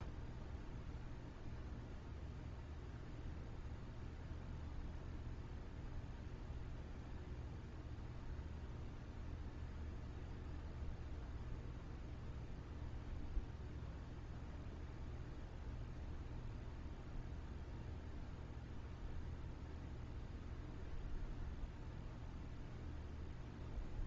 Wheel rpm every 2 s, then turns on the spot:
0, 0, 0, 0, 0, 0, 0, 0, 0, 0, 0, 0.
none